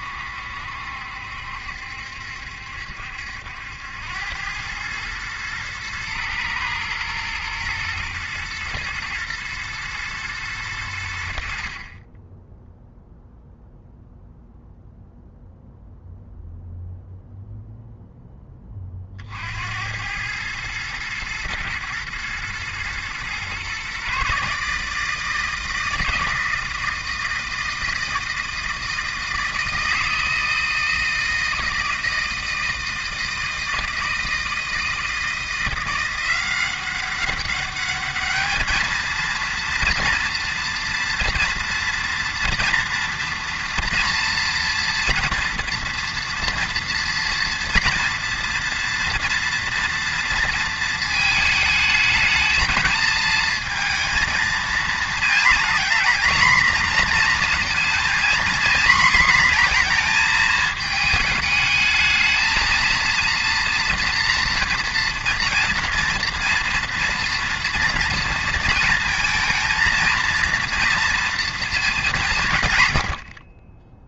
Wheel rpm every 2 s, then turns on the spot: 70, 70, 110, 110, 120, 100, 0, 0, 0, 20, 110, 120, 150, 160, 160, 160, 160, 160, 190, 220, 240, 230, 230, 230, 230, 230, 220, 230, 230, 240, 220, 220, 230, 230, 230, 230, 120.
none